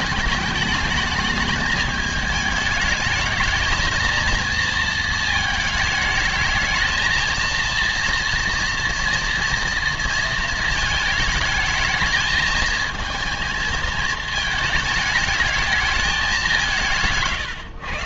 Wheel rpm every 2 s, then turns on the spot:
210, 210, 230, 220, 230, 220, 220, 220, 190.
none